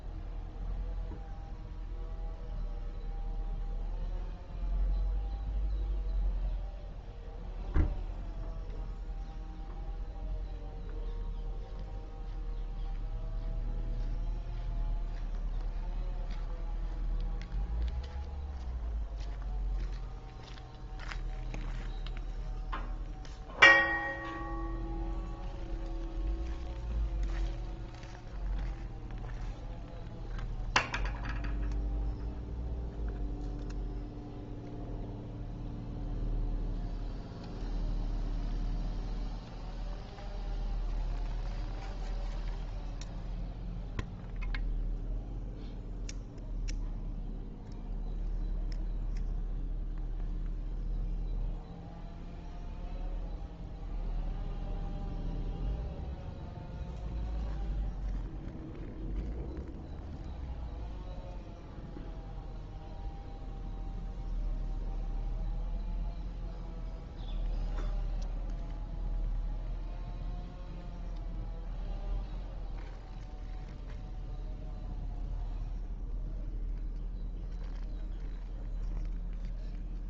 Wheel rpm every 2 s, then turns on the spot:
0, 0, 0, 0, 0, 0, 0, 0, 0, 0, 0, 0, 0, 0, 0, 0, 0, 0, 0, 0, 0, 0, 0, 0, 0, 0, 0, 0, 0, 0, 0, 0, 0, 0, 0, 0, 0, 0, 0, 0.
none